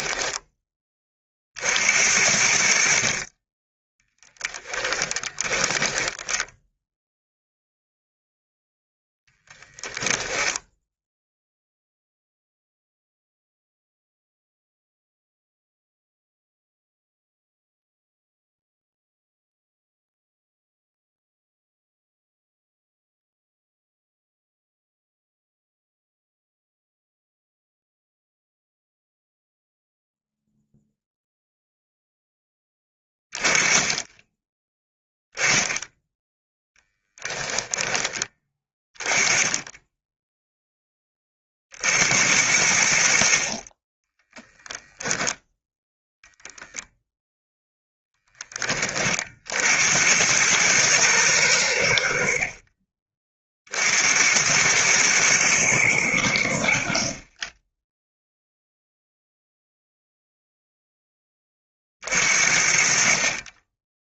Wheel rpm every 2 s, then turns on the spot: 20, 60, 10, 0, 10, 0, 0, 0, 0, 0, 0, 0, 0, 0, 0, 0, 10, 10, 10, 20, 10, 70, 10, 0, 30, 110, 30, 110, 60, 0, 0, 50.
4-6 36-38